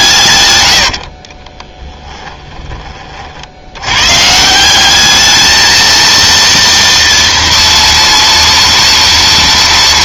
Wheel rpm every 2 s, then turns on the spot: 100, 20, 180, 230, 230.
0-2